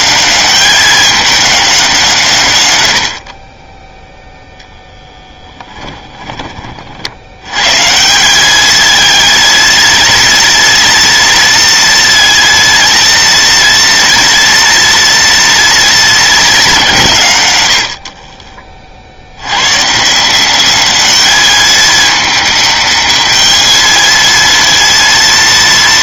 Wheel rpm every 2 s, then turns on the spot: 200, 120, 0, 30, 200, 230, 230, 230, 200, 40, 190, 210, 230.
none